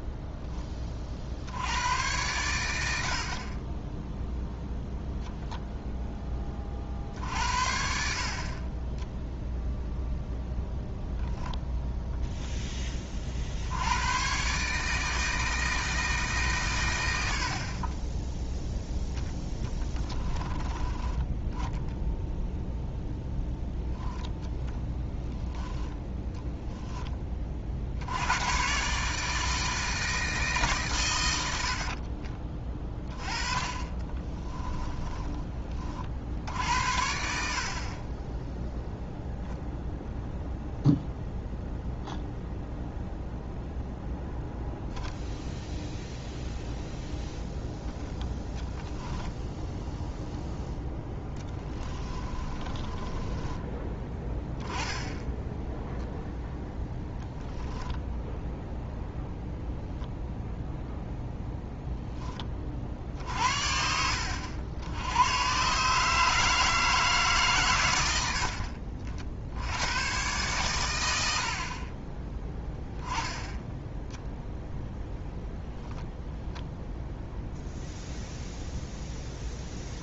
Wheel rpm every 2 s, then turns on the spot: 30, 70, 0, 50, 10, 0, 20, 150, 110, 0, 20, 0, 10, 10, 140, 140, 20, 20, 60, 0, 0, 0, 0, 0, 10, 0, 20, 10, 0, 0, 0, 50, 90, 160, 60, 120, 10, 0, 0, 0.
34-36 48-50 52-54